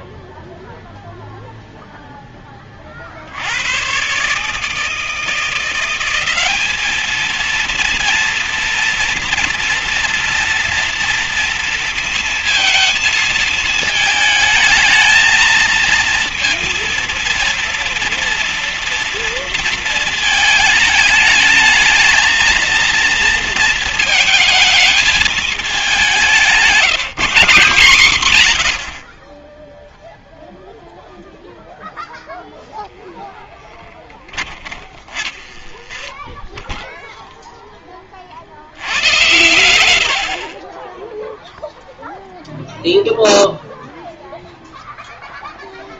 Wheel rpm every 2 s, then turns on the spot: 0, 30, 150, 200, 230, 230, 230, 220, 230, 230, 220, 220, 220, 190, 110, 0, 0, 30, 10, 60, 40, 0, 0.
34-38